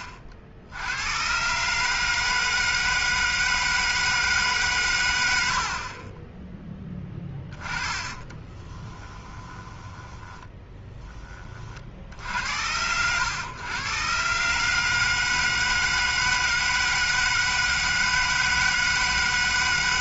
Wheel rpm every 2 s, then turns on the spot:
80, 160, 150, 20, 20, 10, 90, 150, 160, 160.
6-10